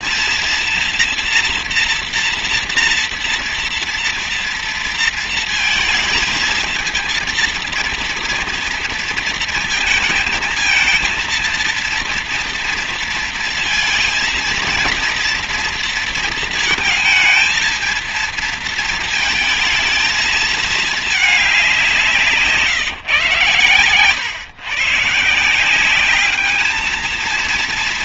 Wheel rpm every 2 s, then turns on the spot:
230, 230, 230, 230, 230, 220, 230, 230, 220, 220, 210, 130, 140, 220.
none